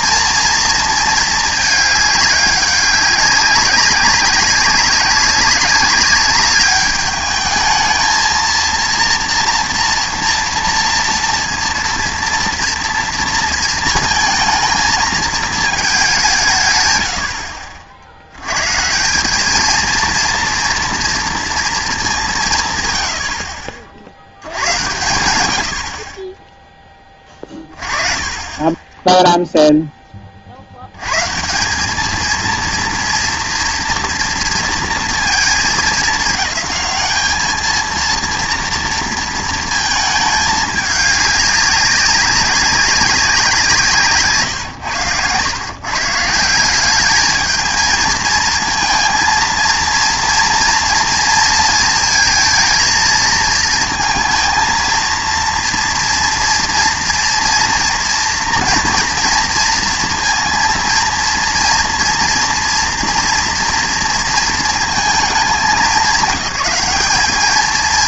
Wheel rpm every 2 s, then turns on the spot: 230, 200, 190, 210, 230, 230, 230, 220, 70, 140, 230, 120, 110, 20, 10, 70, 230, 240, 210, 230, 210, 200, 140, 190, 220, 230, 230, 230, 230, 230, 230, 230, 230, 200.
none